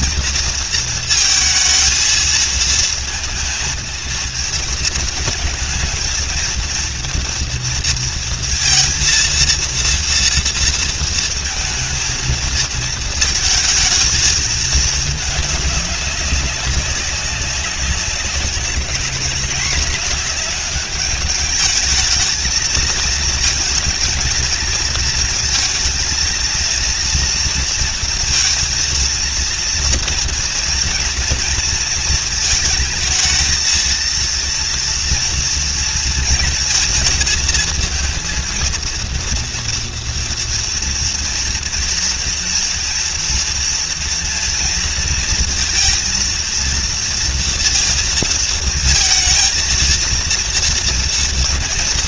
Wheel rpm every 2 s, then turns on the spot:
230, 230, 230, 230, 230, 230, 220, 220, 190, 200, 210, 220, 220, 240, 230, 240, 220, 230, 220, 230, 230, 240, 230, 230, 220, 230.
none